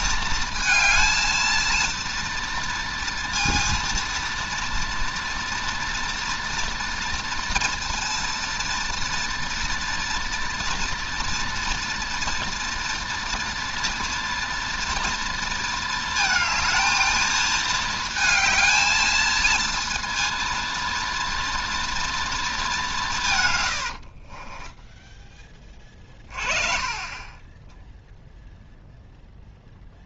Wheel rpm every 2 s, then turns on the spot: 220, 230, 230, 230, 230, 230, 230, 230, 220, 220, 230, 210, 10, 30, 0.
24-28